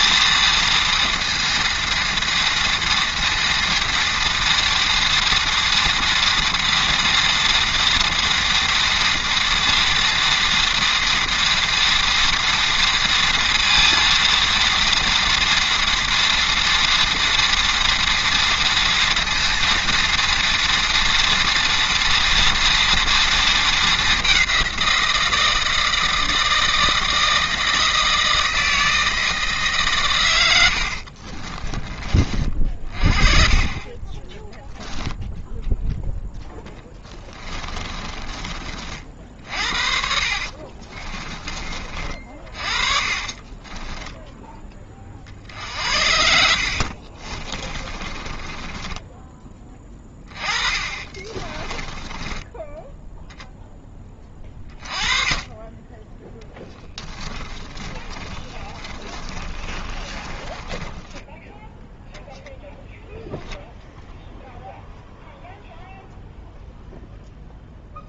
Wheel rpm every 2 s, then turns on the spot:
230, 230, 230, 230, 230, 230, 230, 230, 230, 230, 230, 230, 180, 160, 160, 90, 40, 0, 10, 40, 40, 40, 20, 50, 10, 30, 10, 20, 10, 20, 10, 0, 0, 0.
30-32 40-44 46-54 56-62